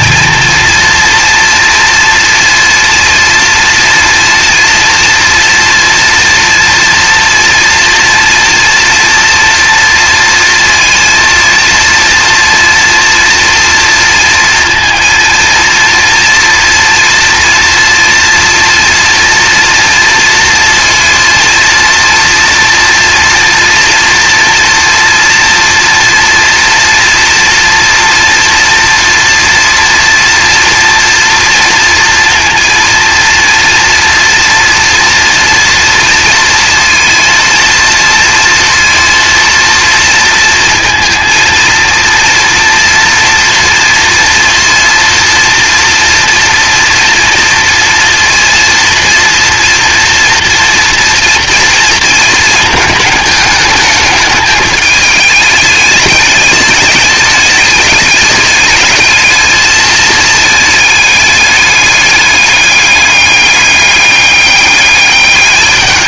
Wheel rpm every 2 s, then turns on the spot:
230, 230, 230, 230, 230, 230, 230, 230, 240, 230, 230, 230, 240, 240, 230, 230, 230, 230, 230, 230, 230, 230, 240, 230, 230, 230, 220, 210, 210, 220, 220, 210, 200.
none